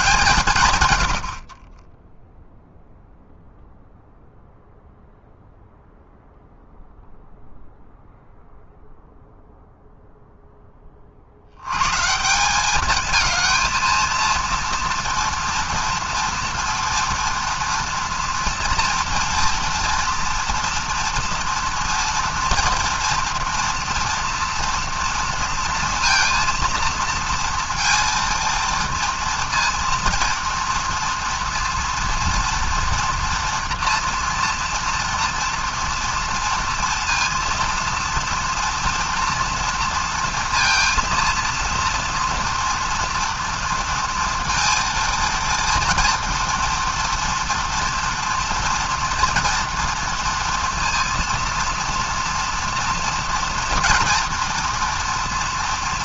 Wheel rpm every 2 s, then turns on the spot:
210, 10, 0, 0, 0, 0, 140, 230, 230, 230, 230, 230, 230, 230, 230, 230, 240, 230, 230, 230, 230, 230, 230, 230, 230, 230, 230, 240.
none